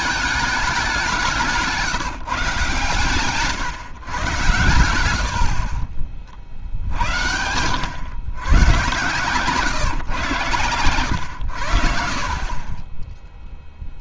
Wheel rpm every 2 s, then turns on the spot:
200, 140, 120, 60, 120, 120, 30.
none